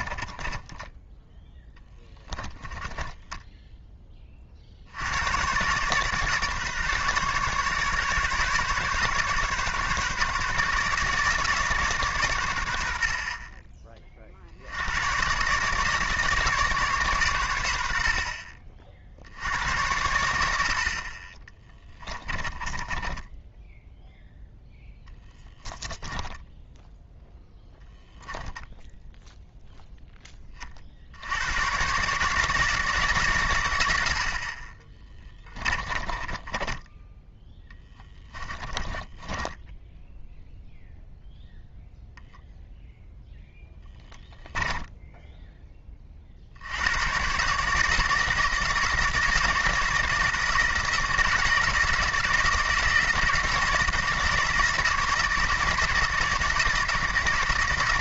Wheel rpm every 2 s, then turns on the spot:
10, 20, 50, 150, 140, 150, 100, 70, 150, 50, 70, 20, 10, 10, 0, 30, 160, 30, 20, 20, 0, 0, 10, 80, 160, 160, 160, 160, 170.
0-4 22-24 26-28 36-40 44-46